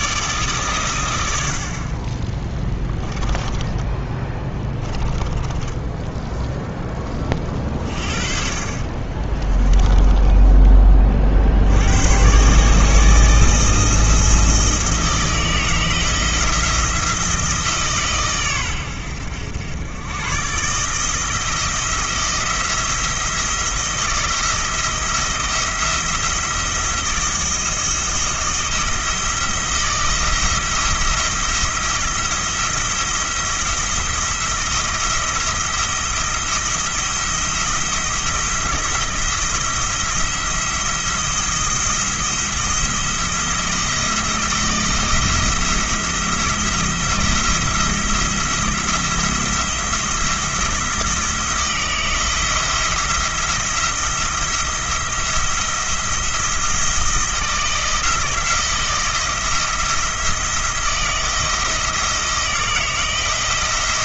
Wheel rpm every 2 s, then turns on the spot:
120, 10, 20, 10, 40, 30, 150, 160, 160, 100, 150, 170, 160, 170, 170, 170, 170, 170, 170, 160, 170, 170, 160, 170, 170, 170, 170, 170, 160, 170, 170, 160.
4-6 8-10